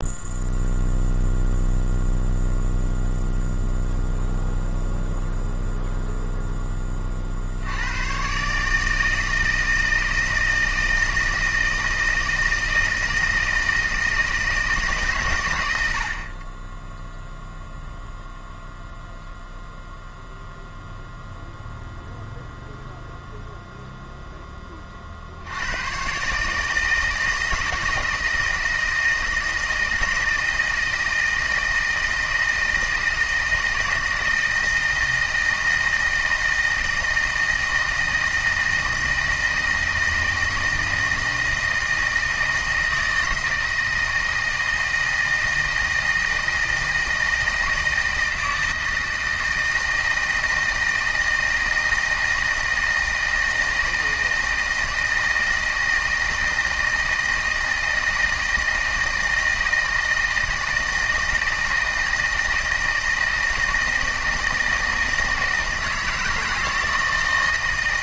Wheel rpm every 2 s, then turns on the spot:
0, 0, 0, 0, 120, 160, 160, 160, 40, 0, 0, 0, 0, 140, 160, 160, 160, 160, 160, 160, 160, 160, 160, 160, 160, 160, 160, 160, 160, 160, 160, 160, 160, 160.
none